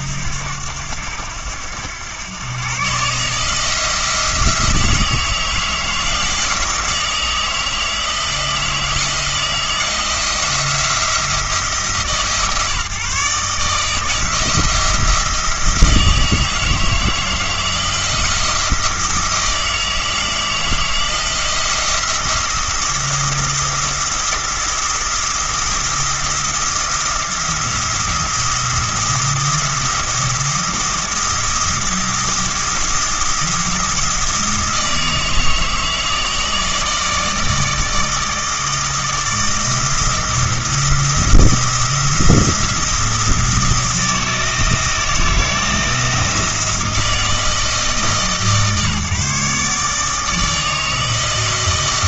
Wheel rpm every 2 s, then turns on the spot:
90, 130, 160, 160, 160, 170, 140, 160, 160, 170, 160, 170, 170, 170, 170, 170, 170, 160, 160, 160, 170, 170, 160, 170, 150, 160.
none